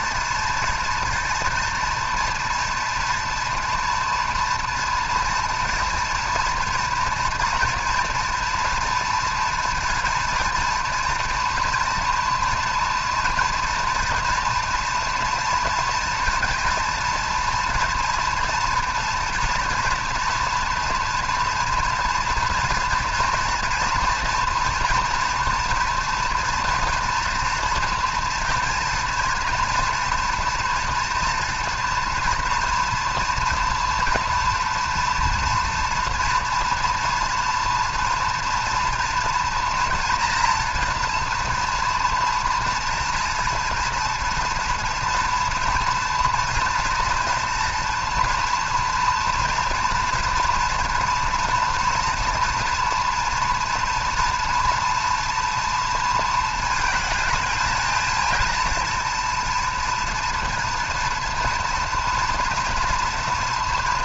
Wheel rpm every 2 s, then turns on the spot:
230, 230, 230, 230, 230, 230, 230, 230, 230, 230, 230, 230, 230, 230, 230, 230, 240, 230, 230, 230, 240, 230, 230, 240, 230, 240, 230, 230, 220, 230, 230, 230.
none